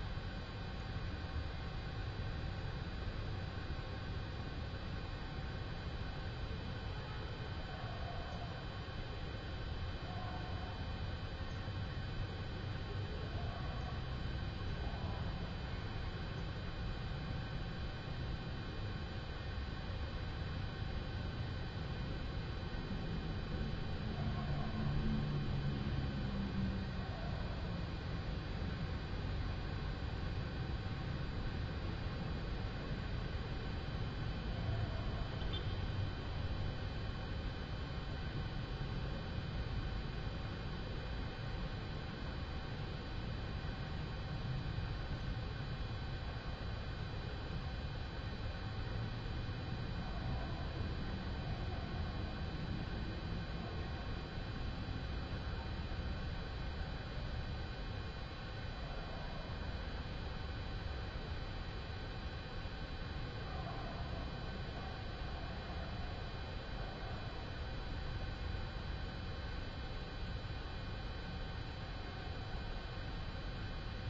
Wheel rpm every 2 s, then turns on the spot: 0, 0, 0, 0, 0, 0, 0, 0, 0, 0, 0, 0, 0, 0, 0, 0, 0, 0, 0, 0, 0, 0, 0, 0, 0, 0, 0, 0, 0, 0, 0, 0, 0, 0, 0, 0, 0.
none